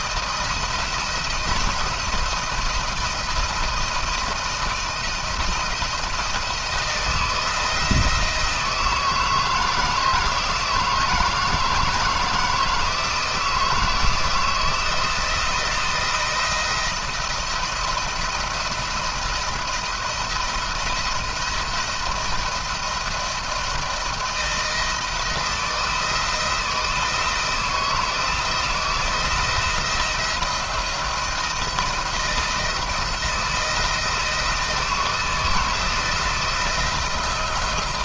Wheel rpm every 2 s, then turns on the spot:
160, 170, 170, 170, 160, 160, 160, 170, 170, 170, 170, 170, 170, 160, 160, 170, 160, 160, 170.
none